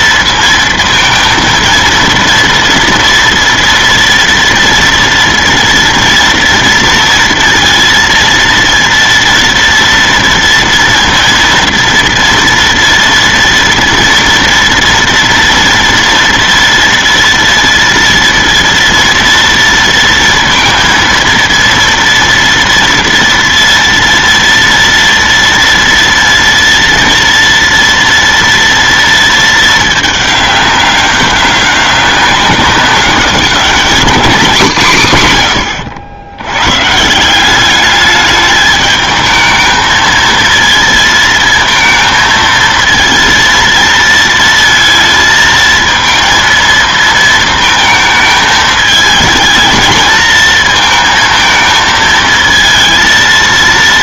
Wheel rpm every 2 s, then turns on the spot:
230, 230, 230, 230, 230, 230, 230, 230, 230, 230, 230, 230, 230, 230, 230, 200, 200, 180, 120, 210, 230, 230, 220, 220, 220, 220, 230.
none